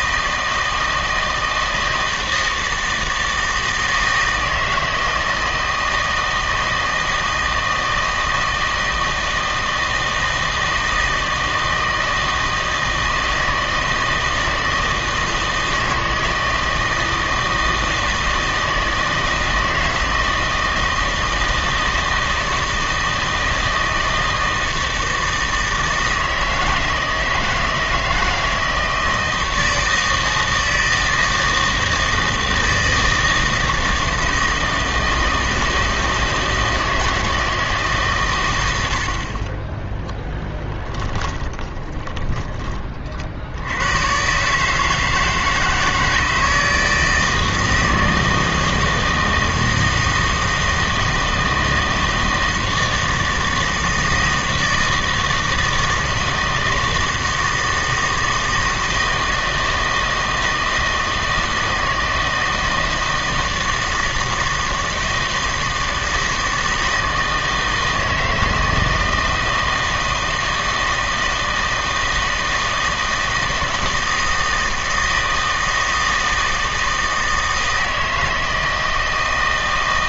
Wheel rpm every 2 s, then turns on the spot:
160, 160, 160, 160, 160, 160, 160, 160, 160, 160, 160, 160, 160, 160, 160, 160, 160, 160, 160, 90, 10, 30, 150, 160, 160, 160, 160, 160, 160, 160, 160, 160, 160, 160, 160, 160, 160, 160, 160, 160.
40-42